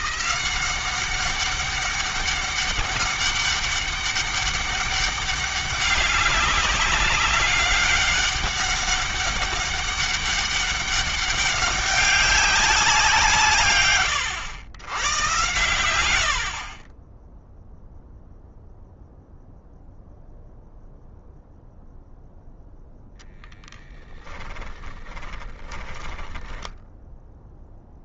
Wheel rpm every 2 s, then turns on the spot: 190, 200, 200, 200, 200, 200, 190, 110, 40, 0, 0, 0, 20, 10.
24-28